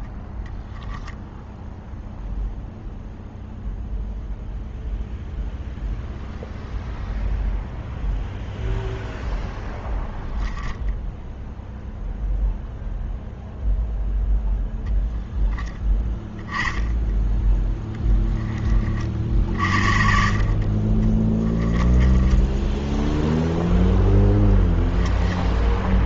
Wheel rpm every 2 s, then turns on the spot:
10, 0, 0, 0, 0, 10, 0, 20, 10, 30, 40, 10, 10.
0-2 10-12 24-26